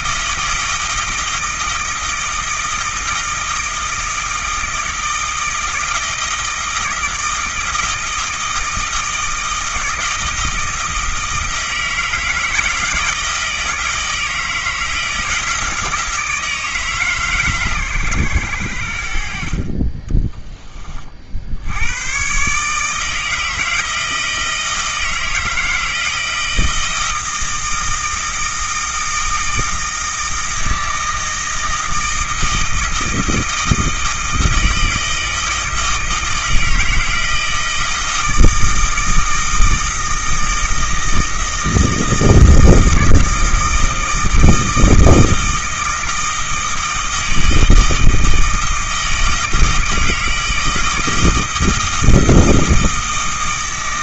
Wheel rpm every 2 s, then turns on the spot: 160, 160, 160, 160, 160, 160, 160, 160, 160, 90, 20, 140, 160, 160, 160, 160, 160, 160, 160, 160, 160, 160, 160, 160, 160, 160, 160.
none